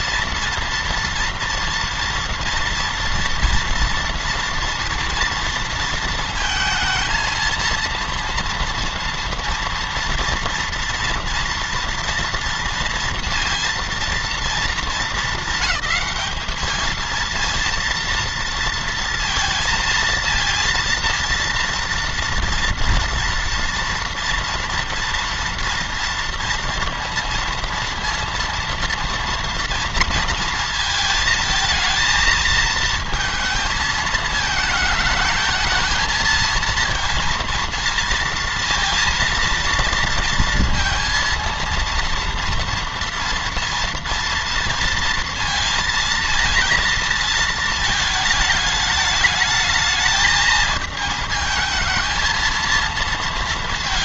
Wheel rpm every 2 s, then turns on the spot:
230, 230, 230, 220, 230, 230, 230, 220, 220, 230, 230, 230, 230, 230, 230, 230, 220, 220, 230, 230, 230, 230, 230, 230, 210, 220, 230.
none